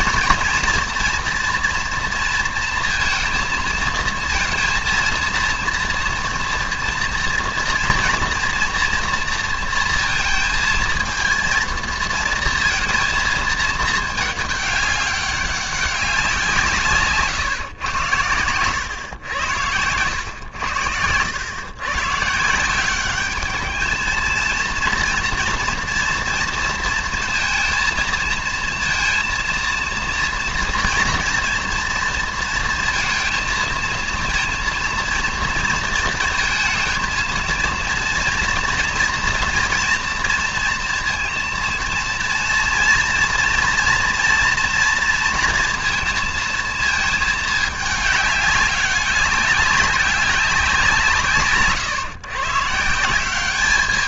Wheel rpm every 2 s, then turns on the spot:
230, 230, 230, 240, 230, 220, 230, 210, 170, 110, 90, 170, 230, 230, 230, 230, 230, 230, 230, 230, 230, 230, 240, 220, 200, 190, 150.
18-20